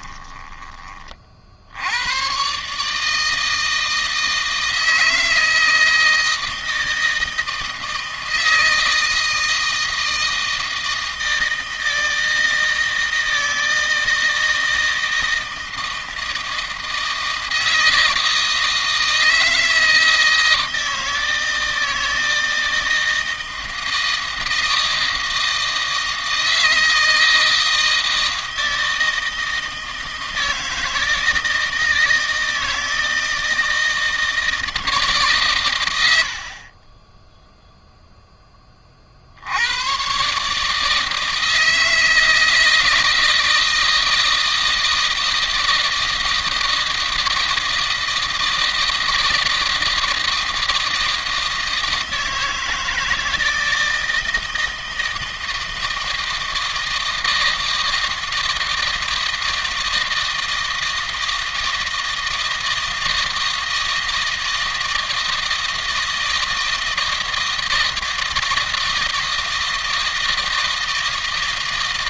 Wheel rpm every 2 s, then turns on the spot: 20, 140, 160, 160, 160, 160, 160, 160, 160, 160, 160, 160, 160, 160, 160, 160, 160, 160, 40, 20, 150, 160, 160, 160, 160, 160, 160, 160, 160, 160, 160, 160, 160, 160, 160, 160.
none